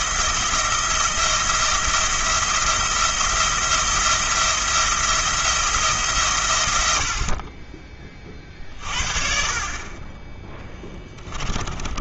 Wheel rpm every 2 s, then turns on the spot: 170, 170, 170, 80, 50, 10.
10-12